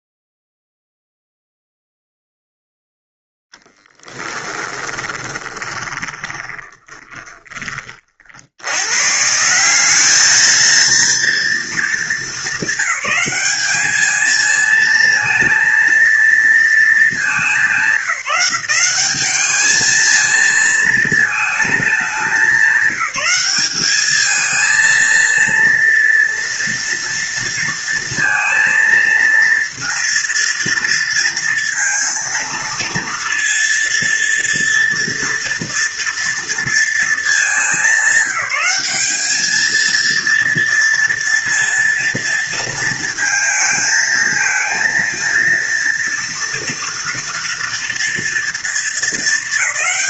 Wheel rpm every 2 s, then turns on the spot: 0, 0, 20, 20, 80, 220, 220, 220, 230, 180, 220, 190, 220, 230, 230, 230, 230, 230, 230, 210, 230, 230, 230, 230, 230.
4-8